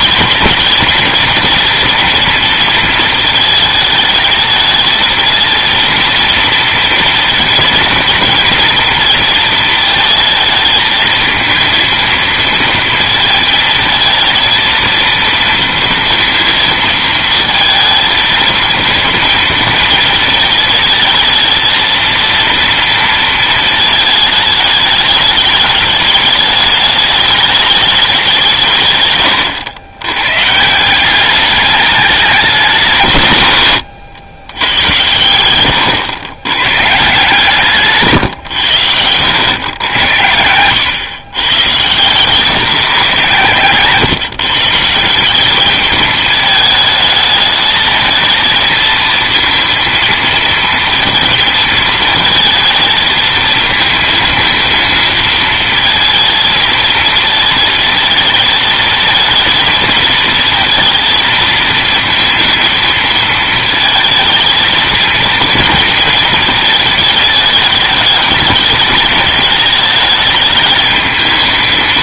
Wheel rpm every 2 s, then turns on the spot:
220, 230, 220, 230, 230, 220, 230, 230, 230, 230, 220, 230, 220, 210, 160, 160, 190, 110, 120, 110, 100, 150, 150, 220, 220, 230, 220, 220, 230, 220, 230, 230, 220, 220, 210, 210.
none